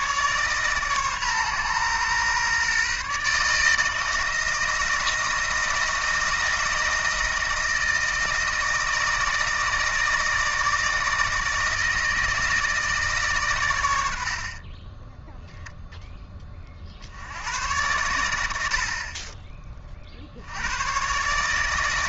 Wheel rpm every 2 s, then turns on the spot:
140, 140, 160, 160, 160, 160, 160, 20, 60, 50, 120.
none